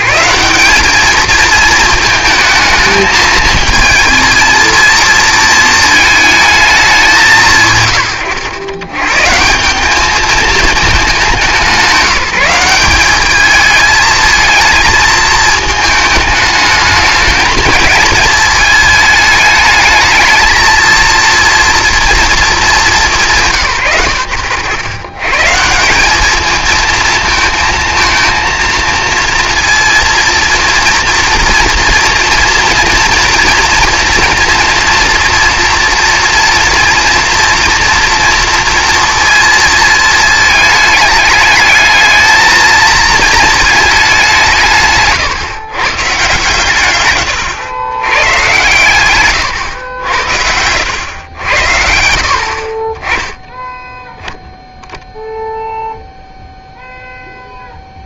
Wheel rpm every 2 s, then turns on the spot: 180, 220, 230, 220, 100, 220, 190, 220, 210, 220, 220, 210, 110, 220, 230, 230, 230, 230, 230, 240, 220, 220, 170, 130, 120, 80, 50, 0, 0.
none